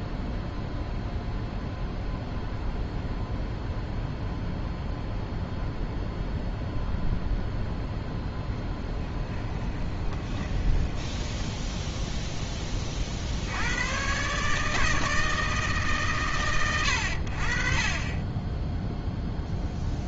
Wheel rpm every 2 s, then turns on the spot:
0, 0, 0, 0, 0, 20, 10, 150, 110, 10.
10-12